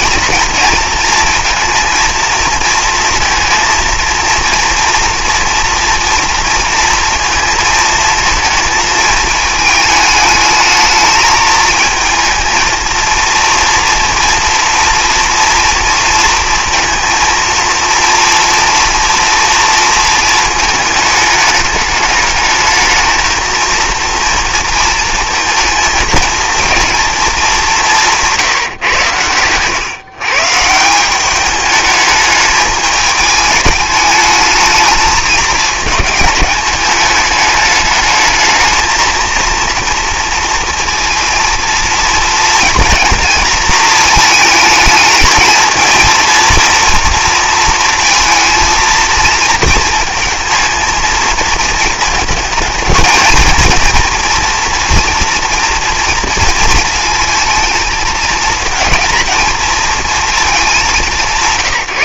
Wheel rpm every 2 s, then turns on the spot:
230, 230, 240, 230, 220, 220, 230, 230, 230, 230, 210, 220, 230, 230, 110, 180, 210, 210, 200, 230, 230, 230, 220, 230, 230, 220, 220, 230, 230, 220, 200.
none